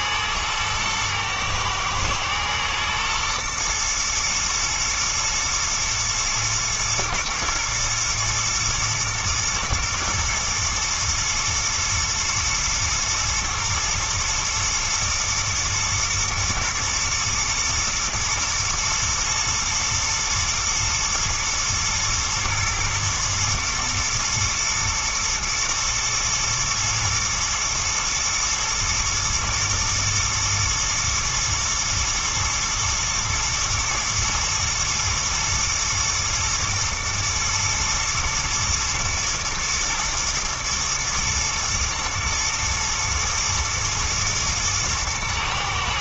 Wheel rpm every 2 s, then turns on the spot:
110, 120, 110, 110, 110, 110, 120, 120, 110, 110, 120, 110, 120, 110, 120, 120, 120, 110, 110, 110, 110, 120, 120.
none